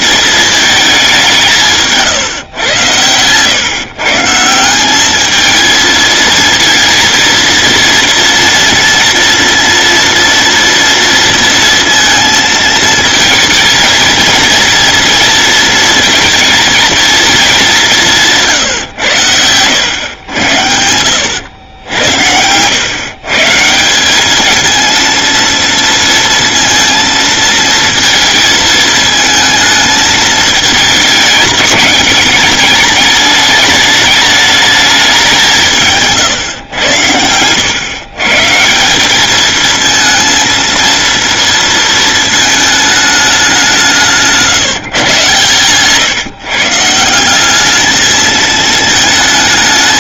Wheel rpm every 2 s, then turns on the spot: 220, 110, 170, 230, 230, 230, 230, 230, 230, 150, 100, 110, 220, 230, 220, 220, 210, 210, 110, 160, 230, 220, 160, 150, 220.
none